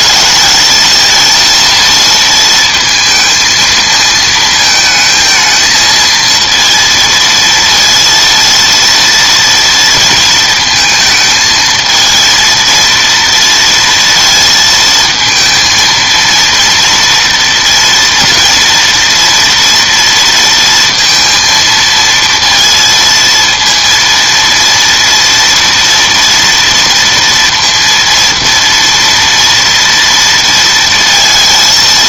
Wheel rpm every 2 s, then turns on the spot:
220, 230, 220, 230, 230, 230, 230, 230, 230, 230, 230, 230, 230, 230, 230, 230.
none